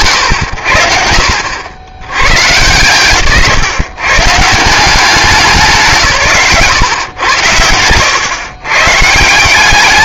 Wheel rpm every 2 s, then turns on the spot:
100, 140, 170, 120, 130.
none